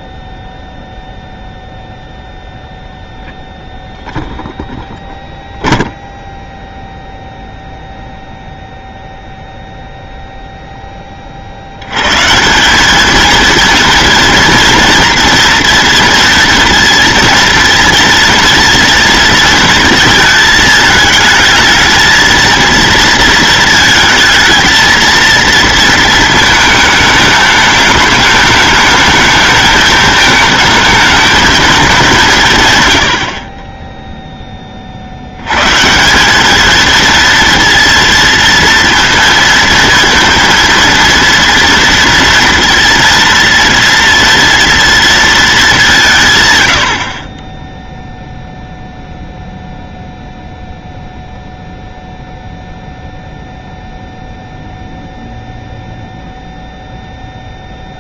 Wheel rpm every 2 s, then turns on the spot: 0, 0, 0, 0, 0, 0, 180, 230, 230, 230, 220, 230, 230, 220, 210, 220, 140, 30, 220, 230, 230, 230, 230, 110, 0, 0, 0, 0, 0.
none